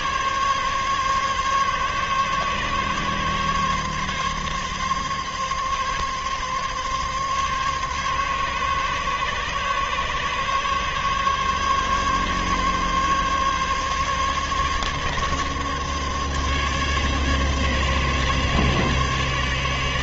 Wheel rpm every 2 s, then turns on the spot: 140, 140, 140, 140, 140, 140, 140, 140, 140, 140.
none